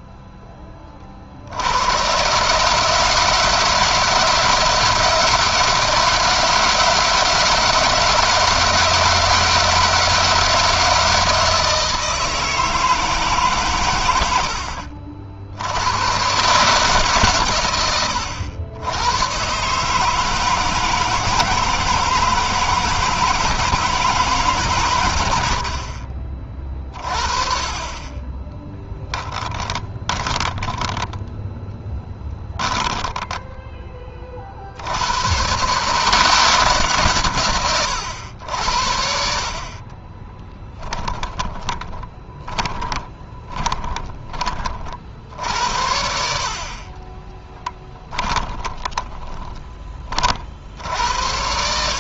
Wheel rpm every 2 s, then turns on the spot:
20, 150, 170, 160, 160, 160, 160, 70, 150, 90, 160, 160, 130, 40, 20, 20, 10, 60, 160, 90, 20, 30, 40, 50, 10, 50.
28-34 40-44 46-50